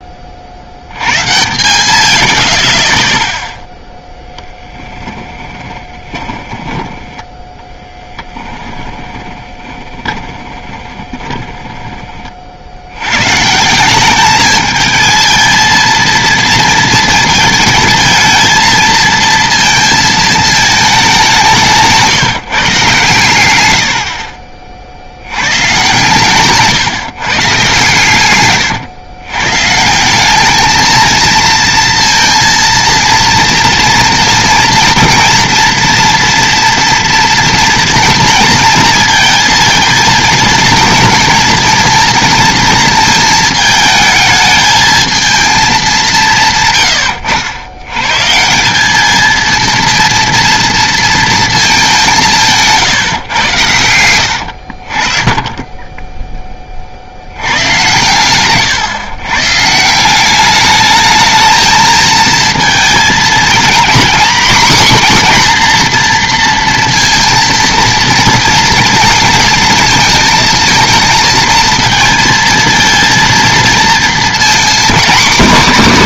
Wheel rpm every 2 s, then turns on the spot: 70, 40, 10, 20, 10, 20, 60, 210, 230, 230, 220, 150, 50, 130, 120, 210, 230, 230, 230, 230, 230, 230, 220, 140, 180, 230, 160, 70, 20, 120, 200, 220, 250, 230, 230, 230, 230, 230.
4-12 28-30 52-54